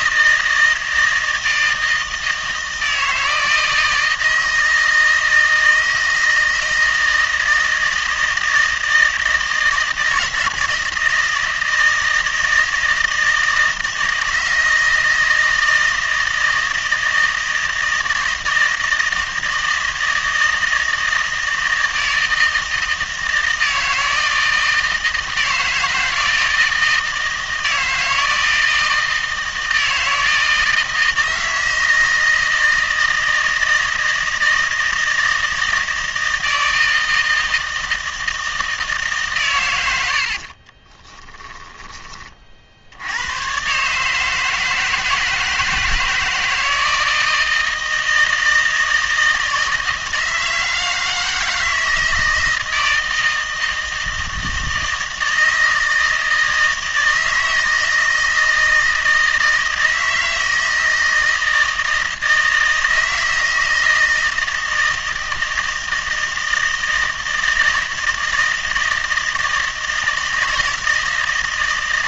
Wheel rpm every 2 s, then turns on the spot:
160, 160, 160, 160, 160, 160, 160, 160, 160, 160, 160, 160, 160, 160, 160, 160, 160, 160, 160, 160, 20, 70, 160, 160, 160, 160, 160, 160, 160, 160, 160, 160, 160, 160, 160, 160.
40-42